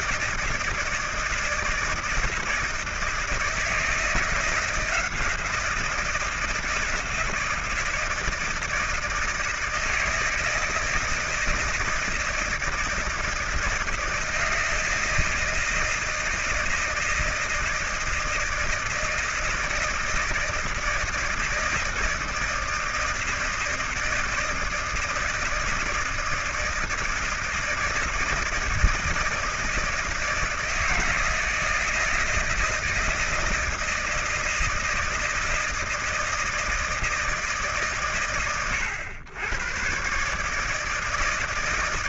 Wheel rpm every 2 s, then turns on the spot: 160, 160, 160, 160, 160, 160, 160, 160, 160, 160, 160, 160, 160, 160, 160, 160, 160, 160, 160, 120, 160.
none